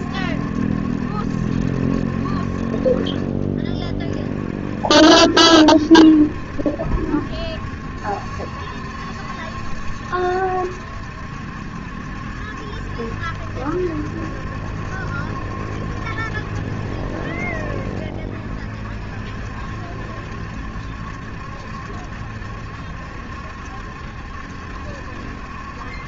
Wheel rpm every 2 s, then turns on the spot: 70, 40, 50, 70, 70, 70, 70, 70, 70, 50, 70, 70, 70.
none